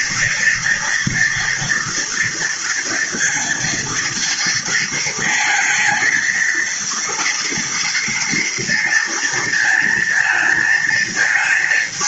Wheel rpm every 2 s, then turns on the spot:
230, 240, 230, 230, 230, 220.
none